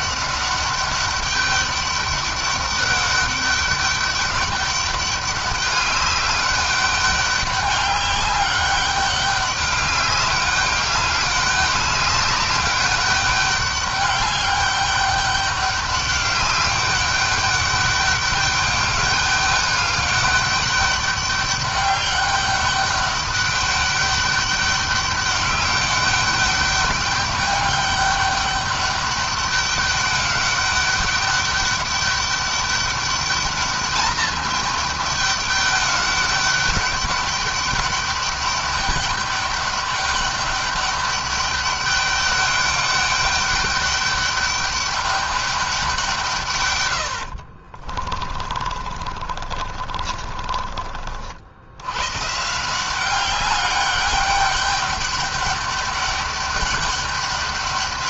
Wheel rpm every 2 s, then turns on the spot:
200, 200, 200, 200, 200, 200, 200, 200, 200, 200, 200, 200, 200, 200, 200, 200, 200, 210, 200, 200, 200, 200, 200, 110, 40, 50, 180, 200, 200.
48-50